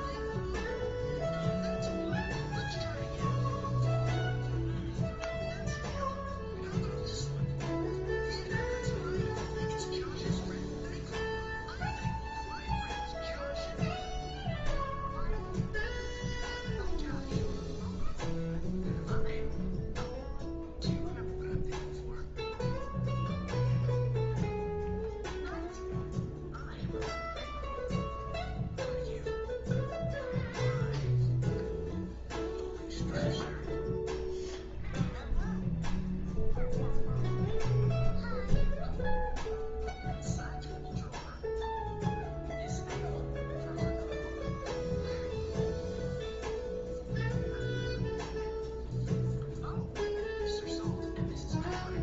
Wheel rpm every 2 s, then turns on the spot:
0, 0, 0, 0, 0, 0, 0, 0, 0, 0, 0, 0, 0, 0, 0, 0, 0, 0, 0, 0, 0, 0, 0, 0, 0, 0.
none